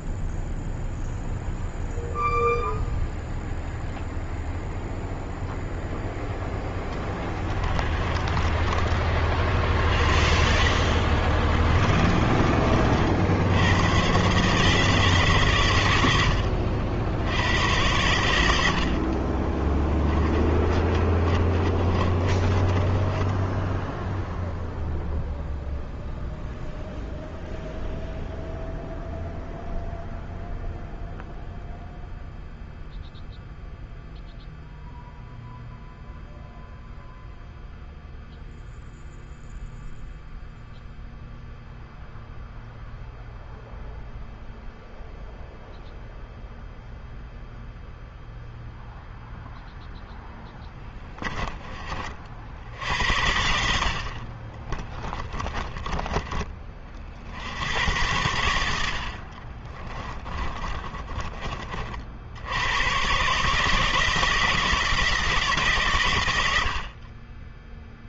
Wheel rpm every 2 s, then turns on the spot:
0, 0, 0, 10, 30, 40, 30, 140, 70, 70, 20, 30, 0, 0, 0, 0, 0, 0, 0, 0, 0, 0, 0, 0, 0, 10, 60, 30, 30, 90, 30, 90, 160, 70.
6-8 20-24 54-56 60-62